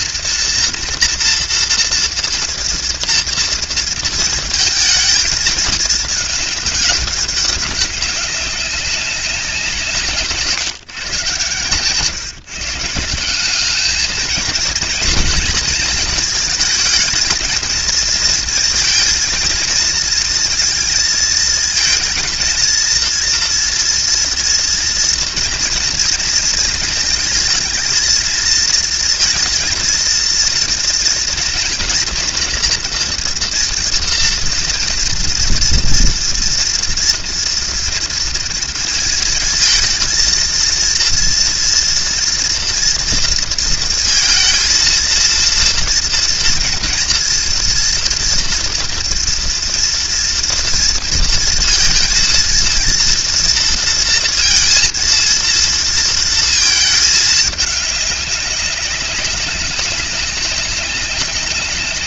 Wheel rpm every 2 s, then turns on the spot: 230, 230, 220, 210, 190, 140, 150, 230, 230, 220, 230, 230, 230, 230, 230, 230, 230, 230, 240, 230, 230, 240, 230, 230, 230, 230, 230, 230, 220, 200, 190.
none